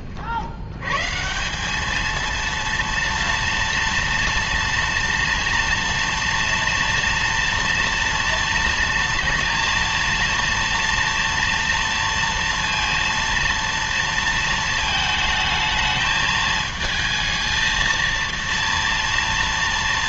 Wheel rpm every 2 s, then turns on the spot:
80, 230, 230, 230, 230, 230, 230, 220, 220, 230.
none